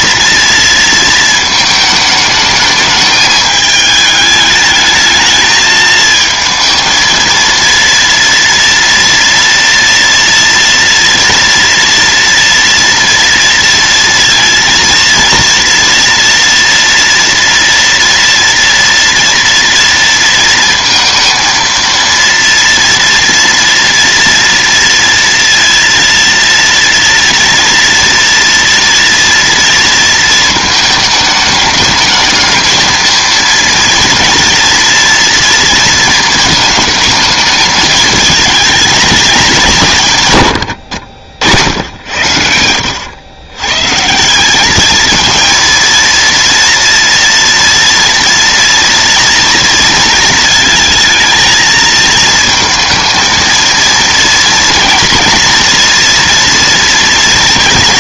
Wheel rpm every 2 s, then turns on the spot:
230, 220, 210, 220, 230, 230, 230, 230, 230, 230, 230, 230, 230, 230, 230, 220, 220, 230, 220, 220, 120, 90, 200, 230, 230, 230, 220, 230, 230.
none